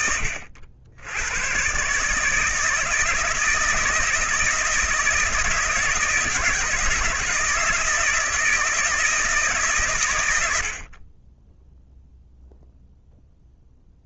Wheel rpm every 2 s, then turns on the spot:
80, 160, 160, 160, 160, 40, 0.
none